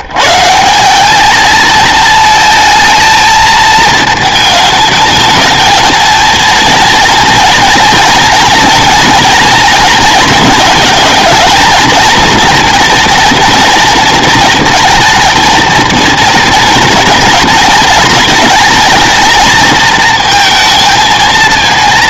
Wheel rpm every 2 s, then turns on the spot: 150, 230, 220, 230, 230, 230, 230, 220, 220, 220, 220.
none